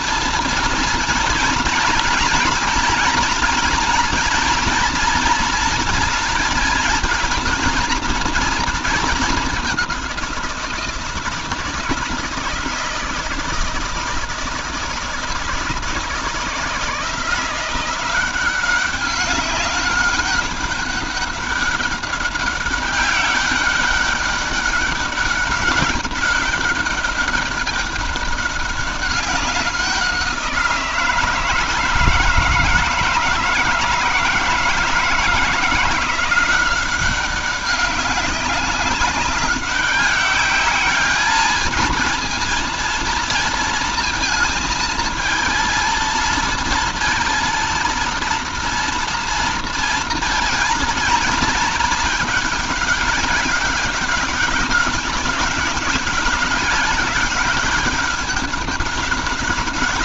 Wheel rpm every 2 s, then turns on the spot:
230, 220, 240, 230, 220, 170, 160, 160, 160, 190, 200, 200, 200, 200, 190, 170, 160, 160, 190, 200, 210, 230, 220, 230, 230, 220, 200, 200, 190, 200.
none